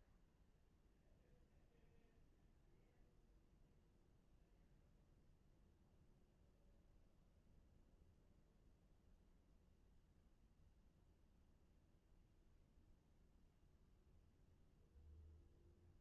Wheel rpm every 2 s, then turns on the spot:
0, 0, 0, 0, 0, 0, 0, 0.
none